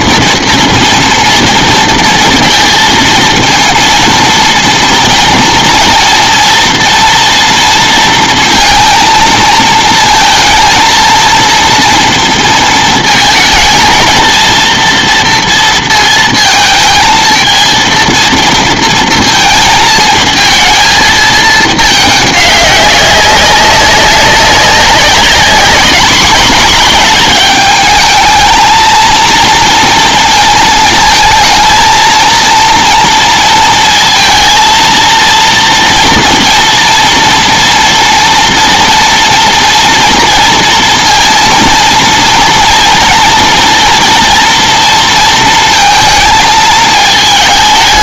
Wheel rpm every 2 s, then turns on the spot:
240, 230, 230, 230, 230, 230, 230, 230, 220, 230, 230, 200, 200, 210, 220, 220, 230, 230, 240, 230, 230, 230, 230, 220.
none